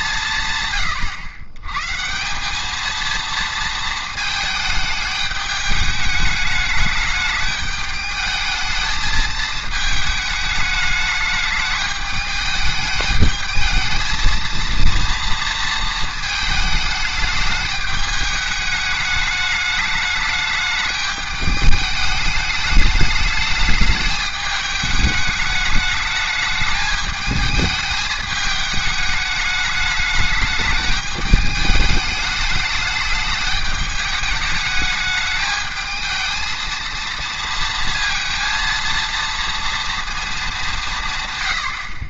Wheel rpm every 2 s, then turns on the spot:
130, 210, 220, 210, 220, 210, 210, 230, 220, 210, 210, 210, 210, 210, 210, 210, 210, 210, 230, 230, 190.
none